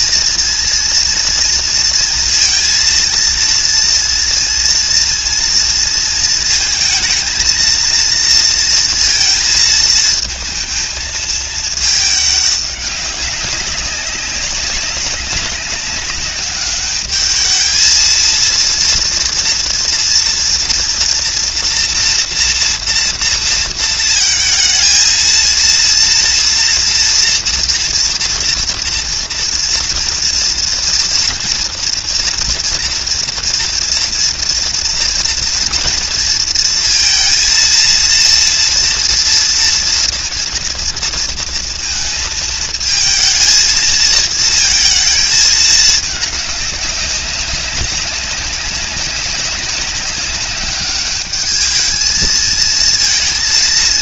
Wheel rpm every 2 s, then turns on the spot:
230, 230, 230, 230, 230, 230, 200, 190, 210, 230, 230, 230, 230, 240, 230, 230, 230, 230, 230, 230, 230, 220, 220, 200, 190, 200, 230.
none